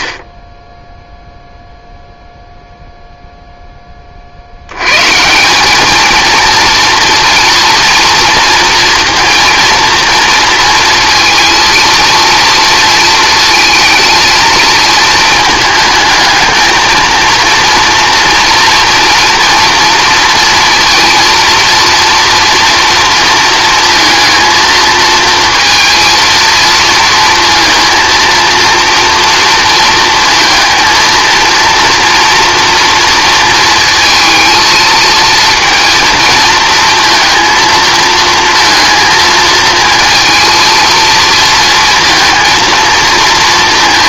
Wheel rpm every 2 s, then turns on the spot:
20, 0, 90, 230, 230, 230, 230, 220, 220, 240, 230, 230, 230, 220, 230, 230, 230, 220, 230, 230, 230, 220.
none